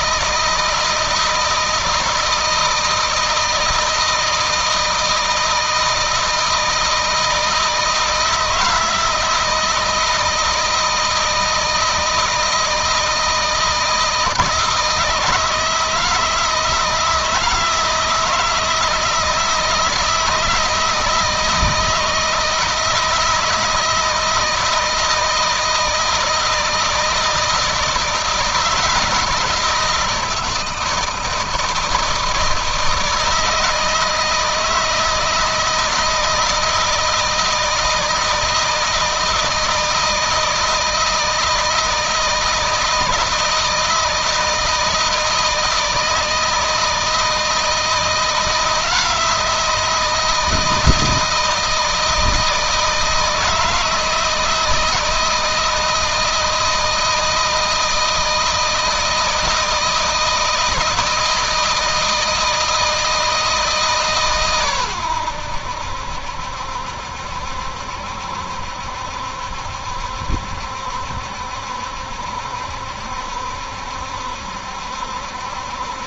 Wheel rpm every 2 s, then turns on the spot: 160, 160, 160, 170, 160, 160, 160, 160, 160, 160, 170, 160, 170, 160, 160, 160, 160, 160, 160, 160, 160, 160, 160, 160, 170, 160, 160, 160, 160, 160, 160, 160, 120, 70, 70, 70, 70, 70.
none